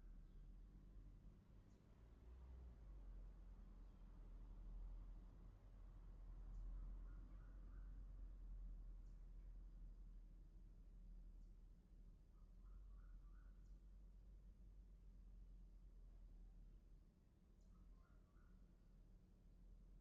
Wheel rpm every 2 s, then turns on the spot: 0, 0, 0, 0, 0, 0, 0, 0, 0, 0.
none